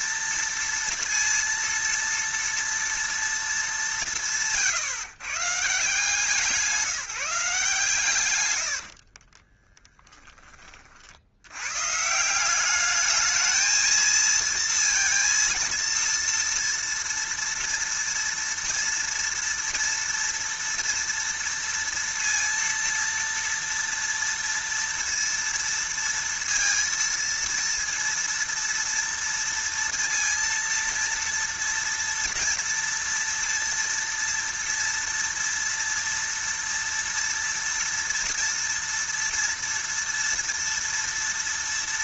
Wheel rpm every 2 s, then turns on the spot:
230, 230, 140, 170, 50, 60, 210, 230, 230, 230, 230, 230, 230, 230, 230, 230, 230, 230, 230, 230, 230.
8-10